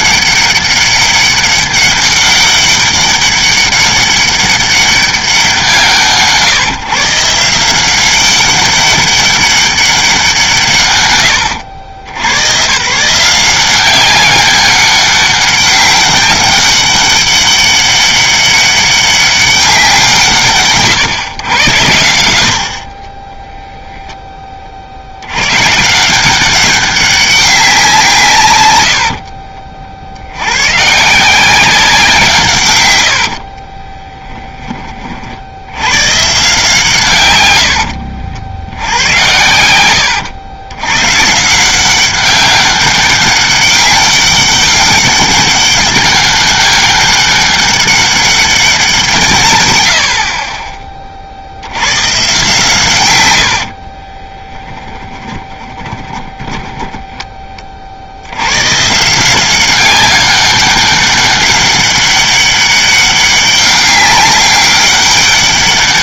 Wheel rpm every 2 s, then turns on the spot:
200, 200, 200, 150, 200, 160, 140, 200, 200, 200, 140, 50, 50, 190, 90, 140, 110, 20, 160, 80, 110, 190, 200, 200, 180, 30, 130, 10, 10, 140, 200, 200, 200.
54-58